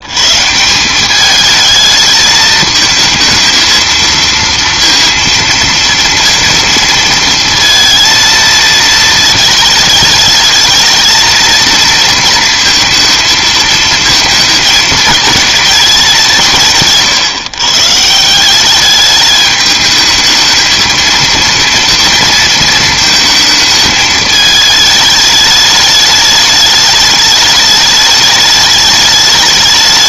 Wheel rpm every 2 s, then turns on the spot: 170, 220, 230, 230, 220, 220, 230, 220, 160, 200, 220, 230, 210, 210, 210.
none